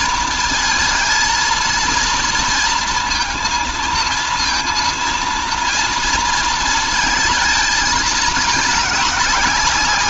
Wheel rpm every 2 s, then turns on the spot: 230, 230, 230, 230, 210.
none